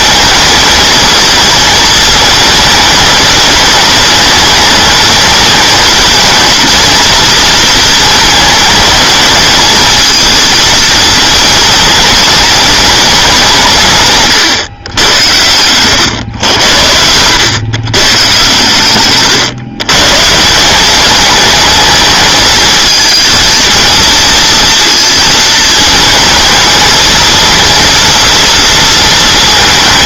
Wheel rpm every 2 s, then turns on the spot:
220, 210, 210, 230, 220, 230, 220, 120, 80, 120, 170, 220, 230, 220, 230.
none